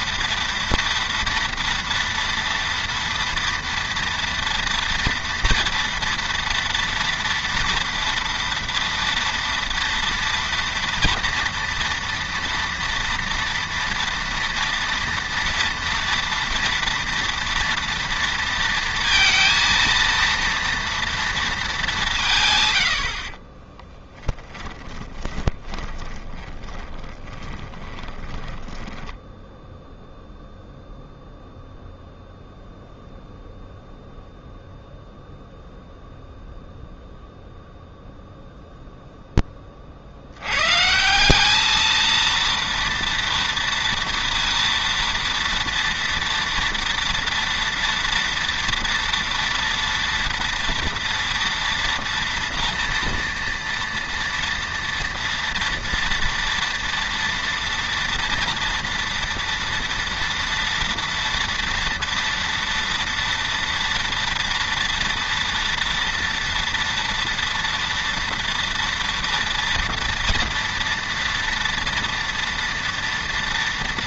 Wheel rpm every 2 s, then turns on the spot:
230, 230, 230, 230, 230, 230, 230, 230, 230, 230, 230, 110, 20, 30, 20, 0, 0, 0, 0, 0, 130, 230, 230, 230, 230, 230, 230, 230, 230, 230, 230, 230, 230, 230, 230, 230, 230.
24-30